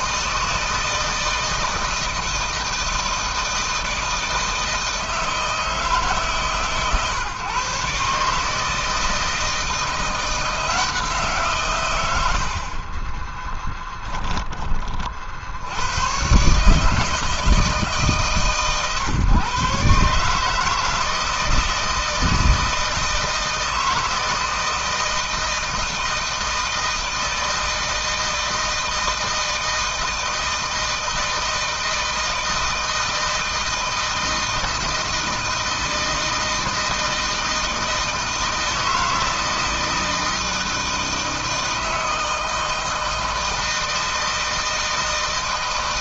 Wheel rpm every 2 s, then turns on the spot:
160, 160, 160, 140, 150, 170, 90, 20, 130, 140, 150, 160, 160, 160, 160, 160, 160, 160, 160, 160, 160, 160, 160.
none